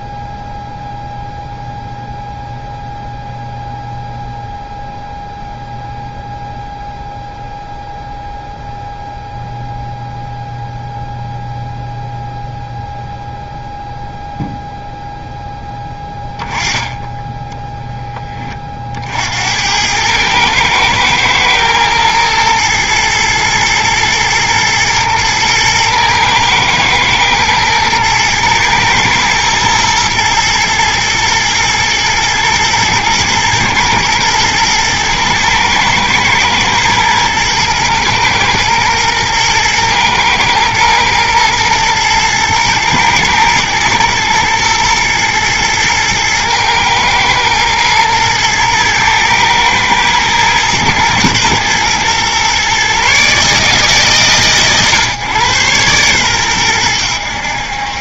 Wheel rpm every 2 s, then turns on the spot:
0, 0, 0, 0, 0, 0, 0, 0, 10, 30, 110, 110, 110, 110, 110, 120, 120, 120, 110, 110, 120, 110, 110, 110, 110, 110, 130, 130, 110.
none